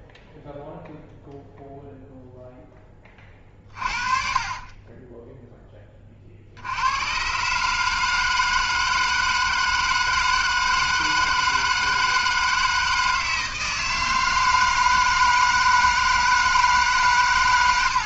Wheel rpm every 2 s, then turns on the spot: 0, 10, 20, 90, 160, 160, 160, 160, 160.
4-6